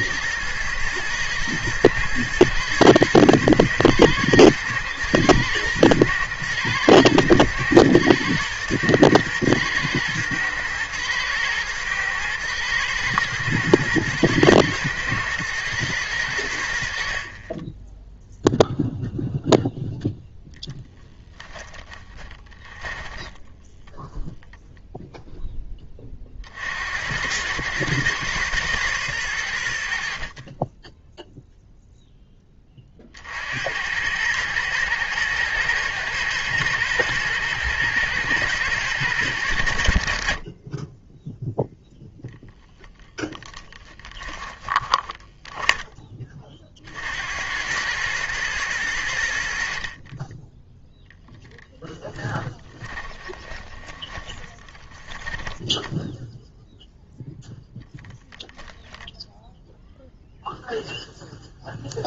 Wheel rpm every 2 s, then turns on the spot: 120, 120, 120, 120, 120, 110, 110, 120, 70, 0, 10, 20, 0, 70, 120, 10, 30, 110, 120, 110, 20, 10, 20, 50, 100, 10, 20, 10, 0, 0, 0.
20-24 44-46 52-56